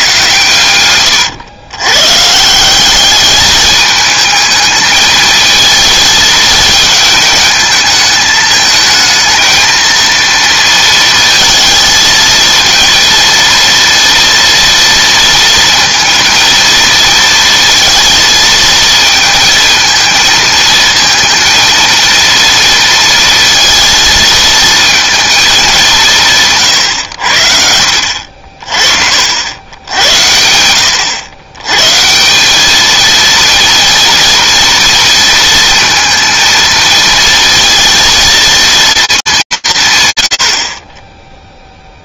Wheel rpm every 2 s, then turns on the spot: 110, 180, 220, 220, 220, 230, 220, 230, 230, 230, 220, 230, 230, 150, 50, 90, 200, 230, 230, 230, 110.
none